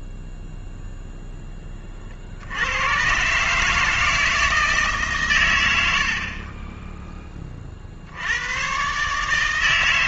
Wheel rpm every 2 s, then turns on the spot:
0, 70, 160, 40, 100.
6-8